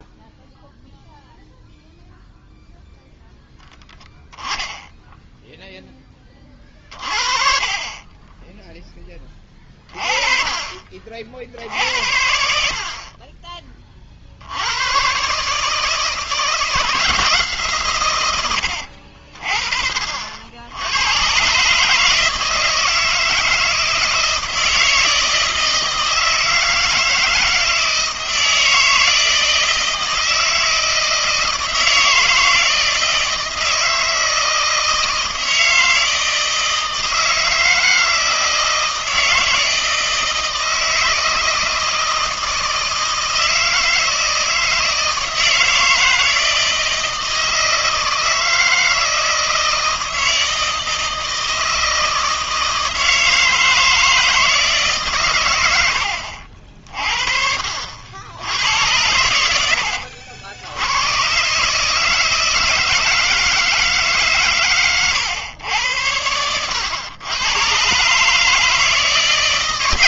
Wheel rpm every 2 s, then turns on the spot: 0, 0, 10, 30, 10, 30, 60, 90, 160, 90, 70, 160, 160, 160, 160, 160, 160, 160, 160, 160, 160, 160, 160, 160, 160, 160, 160, 160, 60, 90, 80, 160, 130, 100, 160.
6-8 18-20 64-66